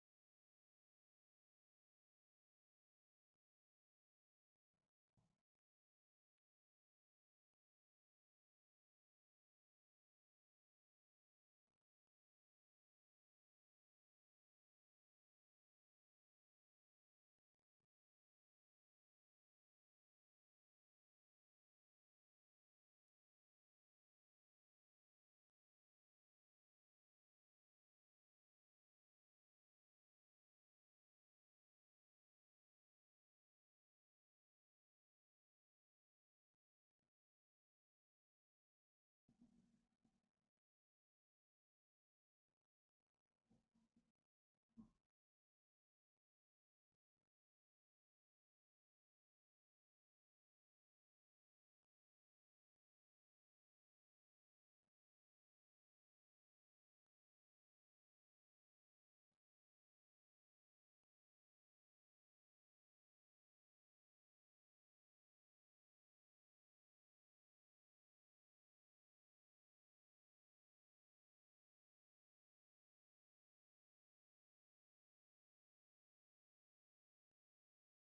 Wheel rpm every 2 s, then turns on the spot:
0, 0, 0, 0, 0, 0, 0, 0, 0, 0, 0, 0, 0, 0, 0, 0, 0, 0, 0, 0, 0, 0, 0, 0, 0, 0, 0, 0, 0, 0, 0, 0, 0, 0, 0, 0, 0, 0, 0.
none